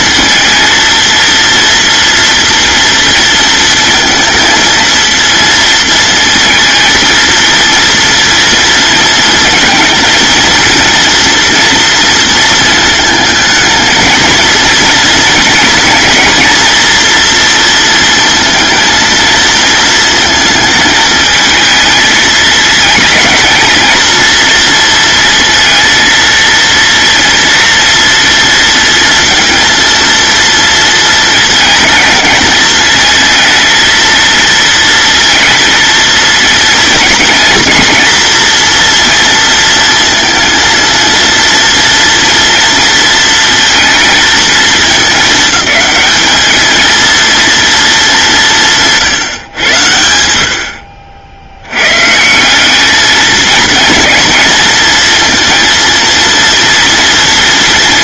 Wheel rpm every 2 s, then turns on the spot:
230, 230, 230, 230, 230, 230, 220, 230, 230, 230, 220, 220, 230, 230, 230, 230, 220, 230, 240, 240, 230, 230, 210, 220, 150, 60, 210, 230, 230.
none